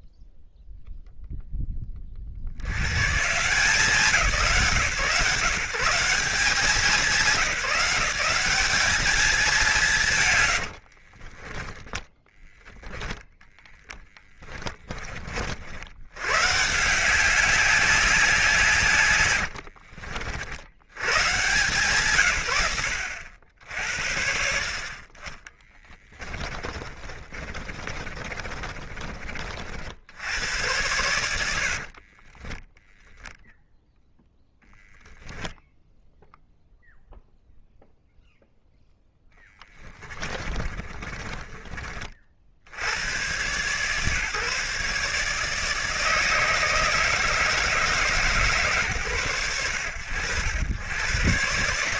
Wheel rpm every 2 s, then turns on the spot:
0, 180, 150, 180, 160, 10, 10, 50, 190, 80, 140, 70, 20, 30, 40, 100, 0, 0, 0, 0, 30, 110, 150, 160, 110, 120.
10-14 18-20 24-28 40-42